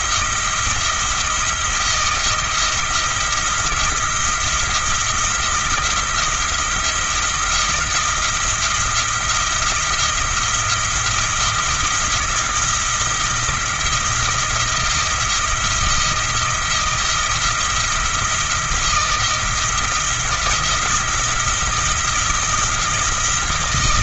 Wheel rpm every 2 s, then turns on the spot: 170, 170, 170, 170, 170, 170, 170, 170, 170, 170, 170, 170.
none